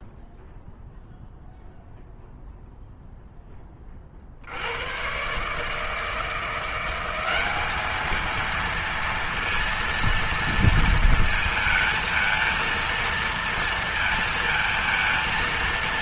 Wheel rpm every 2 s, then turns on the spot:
0, 0, 50, 160, 220, 230, 230, 230.
none